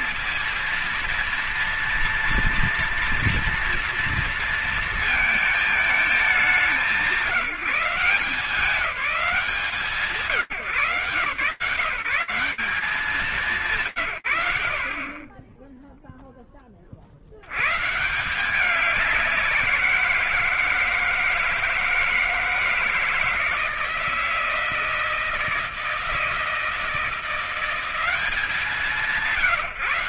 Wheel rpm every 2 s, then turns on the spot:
230, 230, 230, 180, 170, 130, 180, 120, 40, 190, 160, 160, 160, 170, 180.
none